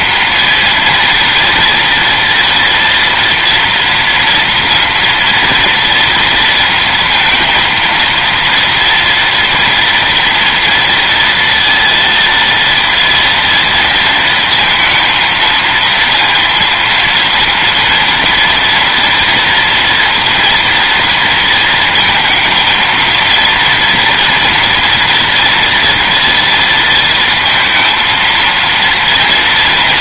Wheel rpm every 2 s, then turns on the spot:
230, 230, 230, 230, 230, 230, 230, 230, 230, 230, 230, 220, 230, 230, 230.
none